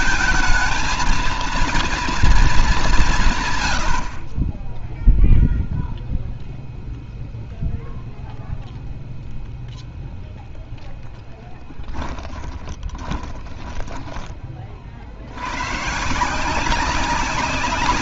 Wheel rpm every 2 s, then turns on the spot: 230, 230, 40, 0, 0, 10, 30, 20, 170.
12-14